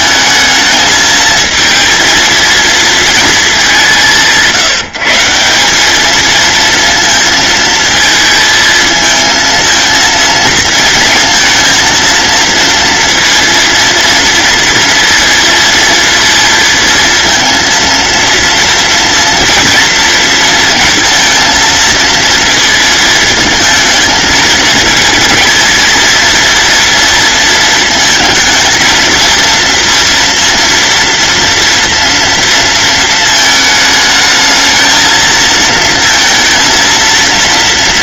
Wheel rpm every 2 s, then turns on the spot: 220, 220, 170, 230, 220, 230, 230, 230, 230, 230, 230, 230, 230, 230, 230, 230, 220, 220, 230.
none